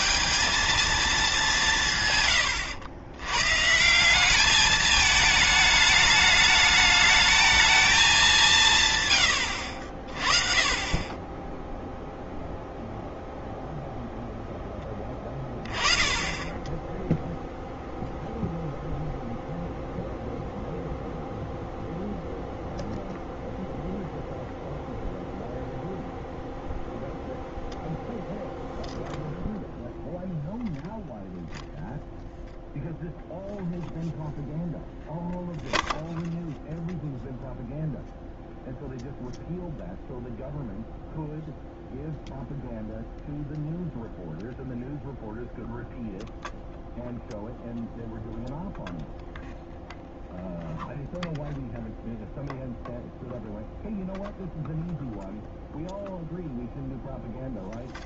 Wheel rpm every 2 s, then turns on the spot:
220, 110, 210, 210, 150, 20, 0, 10, 10, 0, 0, 0, 0, 0, 0, 0, 0, 0, 0, 0, 0, 0, 0, 0, 0, 0, 0, 0, 0.
none